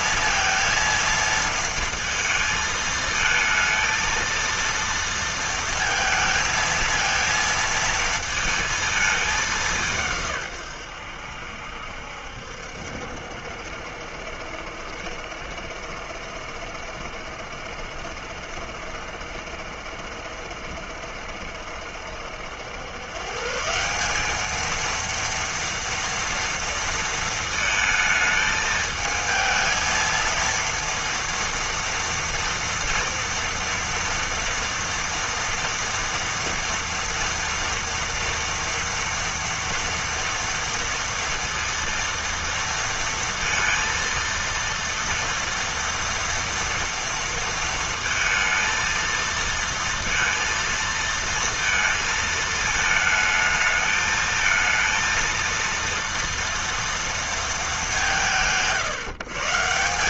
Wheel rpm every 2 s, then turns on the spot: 230, 220, 230, 220, 220, 110, 70, 70, 70, 70, 70, 100, 220, 230, 220, 230, 230, 230, 230, 230, 230, 230, 230, 230, 230, 230, 220, 230, 230, 130.
none